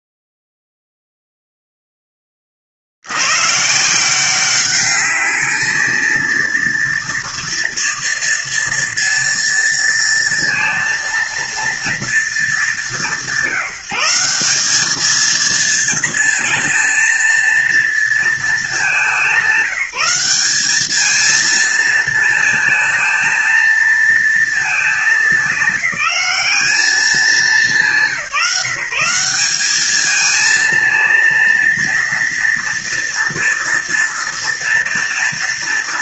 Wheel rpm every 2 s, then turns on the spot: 0, 20, 190, 230, 230, 230, 210, 180, 230, 220, 190, 230, 220, 210, 180, 220, 230, 230.
none